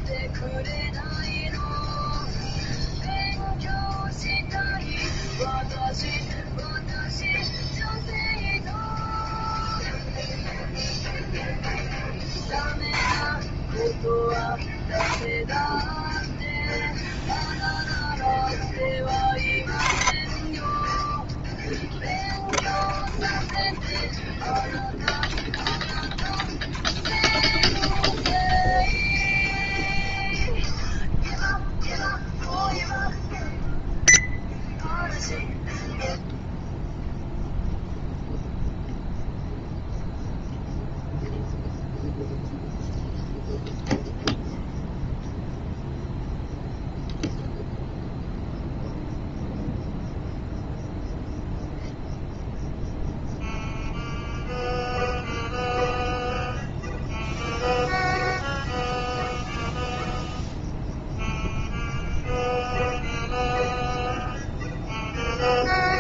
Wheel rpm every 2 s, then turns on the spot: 0, 0, 0, 0, 0, 0, 20, 20, 0, 10, 10, 10, 10, 10, 0, 0, 0, 0, 0, 0, 0, 0, 0, 0, 0, 0, 0, 0, 0, 0, 0, 0, 0.
none